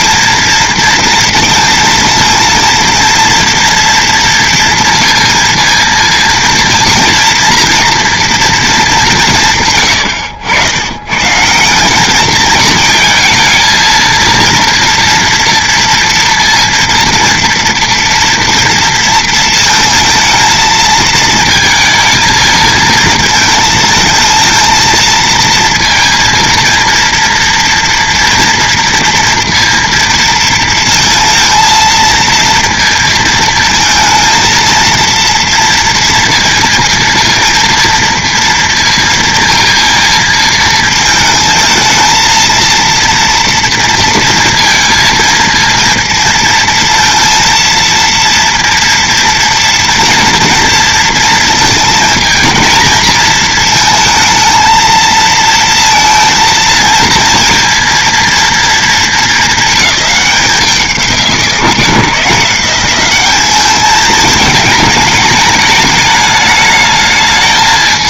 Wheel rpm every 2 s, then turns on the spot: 230, 230, 230, 230, 220, 90, 220, 230, 230, 240, 230, 220, 220, 230, 240, 230, 230, 230, 230, 230, 220, 230, 230, 230, 230, 230, 230, 230, 220, 230, 190, 180, 210, 220.
none